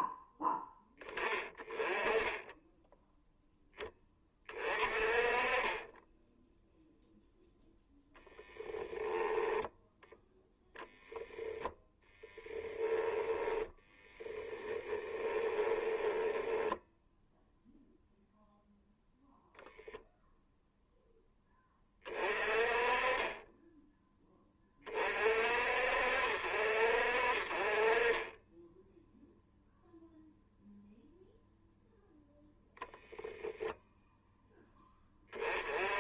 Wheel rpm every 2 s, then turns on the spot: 10, 0, 40, 0, 10, 20, 10, 20, 0, 0, 0, 30, 30, 50, 0, 0, 0, 10.
8-12 14-16